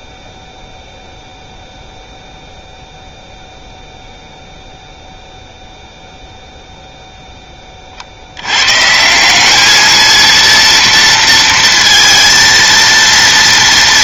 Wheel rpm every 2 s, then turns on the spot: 0, 0, 0, 0, 90, 230, 230.
none